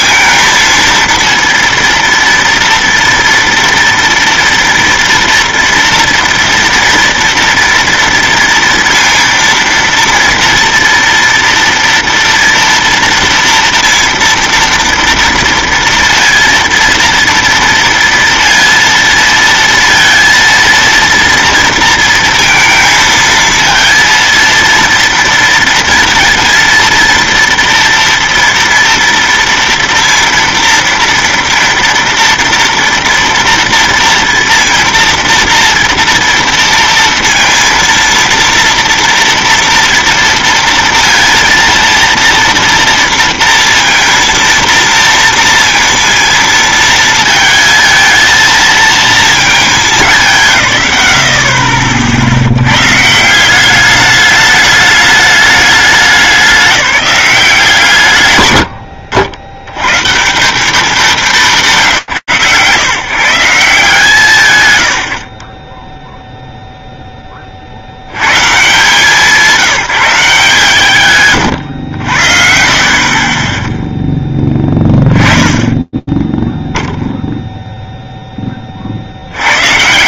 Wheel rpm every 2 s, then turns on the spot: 230, 230, 230, 230, 230, 230, 230, 230, 230, 230, 230, 230, 230, 230, 230, 230, 230, 230, 230, 230, 230, 230, 230, 230, 230, 160, 70, 210, 200, 130, 190, 120, 150, 0, 140, 160, 50, 10, 0, 50.
none